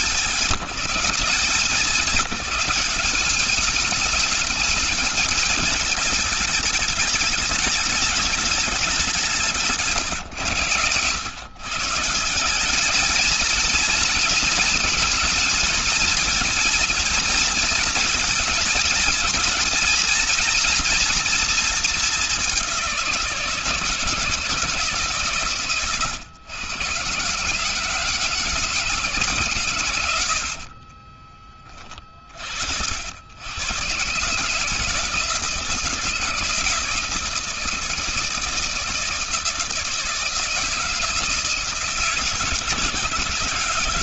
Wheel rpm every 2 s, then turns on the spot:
190, 200, 220, 210, 180, 120, 220, 220, 230, 220, 230, 180, 150, 140, 150, 30, 90, 170, 160, 160, 160, 160.
30-32